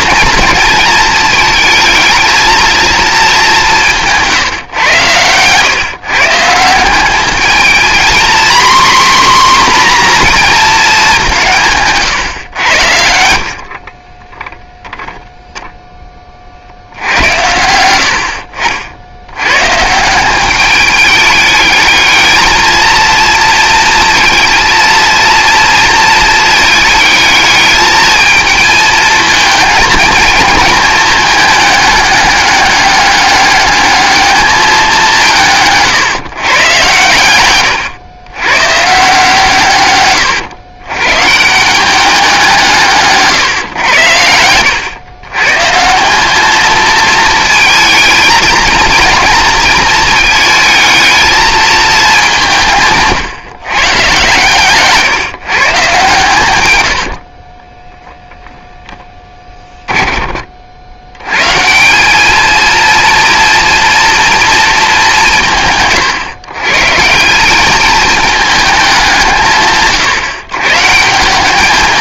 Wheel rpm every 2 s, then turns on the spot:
220, 230, 120, 180, 260, 220, 80, 20, 70, 70, 200, 220, 230, 220, 220, 220, 200, 200, 120, 130, 110, 160, 100, 220, 230, 220, 160, 140, 100, 10, 70, 230, 220, 140, 200, 140.
12-16 54-56 58-60